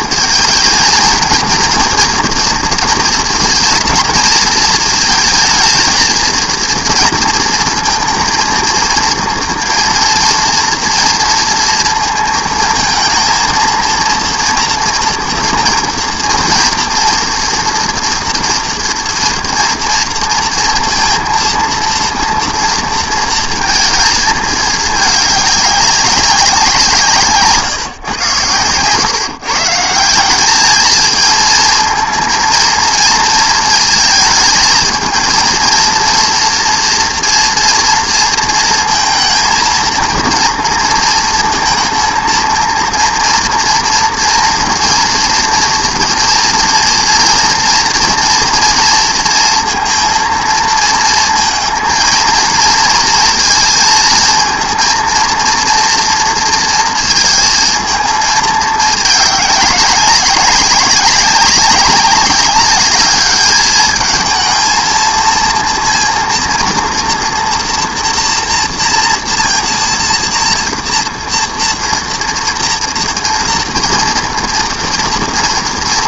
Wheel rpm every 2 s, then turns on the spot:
220, 230, 220, 230, 230, 230, 230, 230, 230, 240, 230, 230, 220, 180, 110, 210, 230, 220, 230, 230, 230, 230, 240, 230, 240, 230, 230, 220, 230, 210, 200, 210, 230, 230, 240, 230, 240, 230.
none